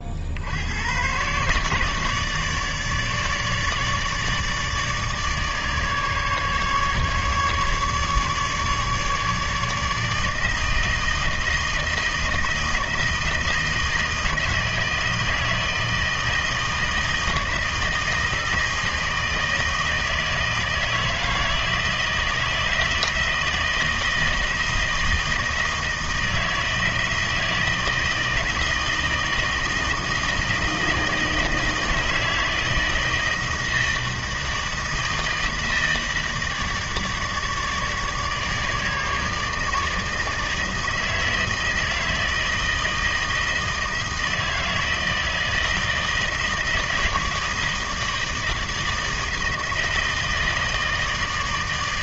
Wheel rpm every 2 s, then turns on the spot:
70, 150, 150, 150, 150, 160, 160, 160, 160, 160, 160, 160, 160, 160, 160, 160, 160, 160, 160, 150, 160, 160, 160, 160, 160, 160.
none